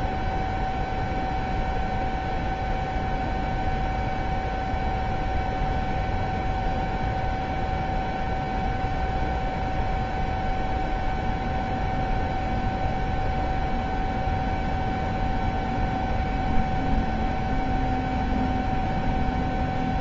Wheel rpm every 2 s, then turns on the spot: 0, 0, 0, 0, 0, 0, 0, 0, 0, 0.
none